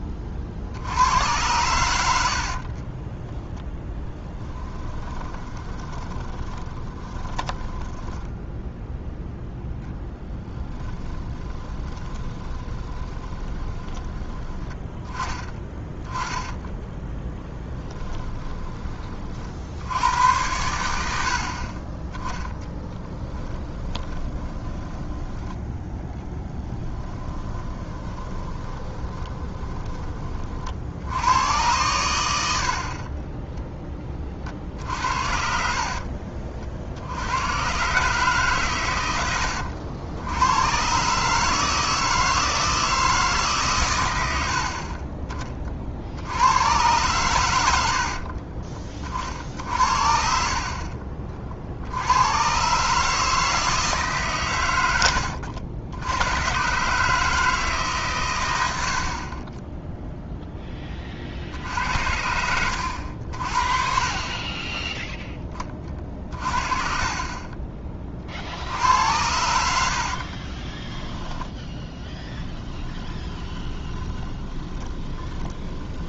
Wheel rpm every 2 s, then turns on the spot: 70, 30, 10, 20, 0, 20, 20, 20, 10, 20, 90, 10, 20, 10, 20, 60, 50, 60, 60, 110, 120, 160, 60, 110, 50, 50, 140, 100, 130, 80, 20, 90, 10, 40, 70, 20, 20, 20.
2-8 10-14 16-18 22-30 66-68 70-76